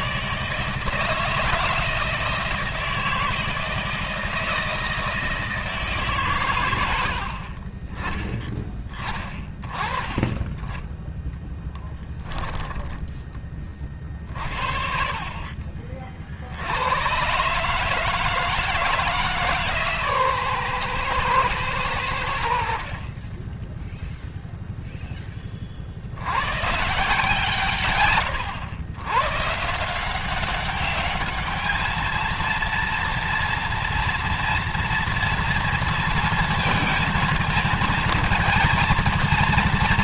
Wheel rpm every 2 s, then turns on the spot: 160, 160, 160, 90, 20, 10, 10, 40, 110, 160, 120, 40, 0, 150, 120, 200, 230, 230, 230, 230.
10-12 14-16